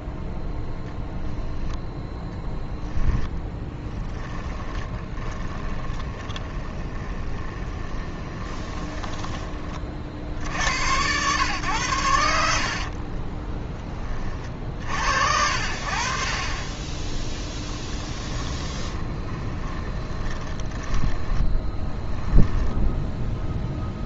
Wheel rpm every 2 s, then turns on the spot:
0, 10, 20, 20, 10, 80, 60, 50, 20, 20, 10, 10.
2-10 12-14 18-24